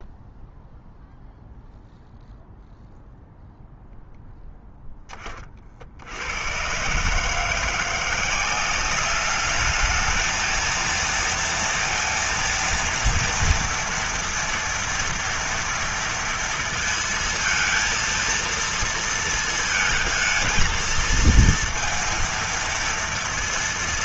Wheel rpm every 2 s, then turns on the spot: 0, 0, 0, 100, 190, 230, 230, 230, 230, 230, 230, 230.
none